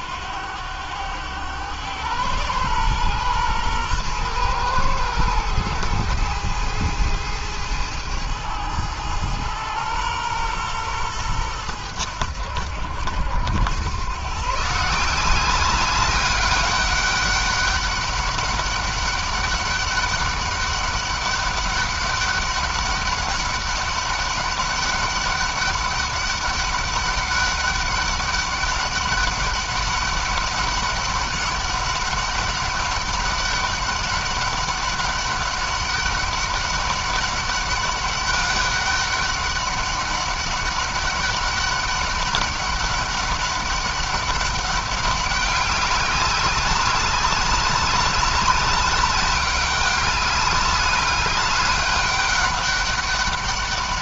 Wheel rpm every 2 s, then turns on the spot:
100, 120, 110, 110, 110, 110, 80, 160, 200, 200, 200, 200, 200, 200, 190, 200, 200, 200, 200, 200, 200, 200, 190, 190, 200, 200, 200.
none